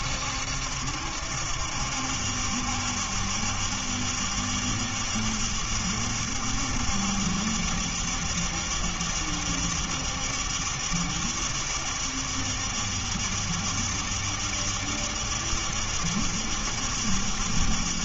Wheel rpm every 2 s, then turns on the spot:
70, 70, 70, 70, 70, 70, 70, 70, 70.
none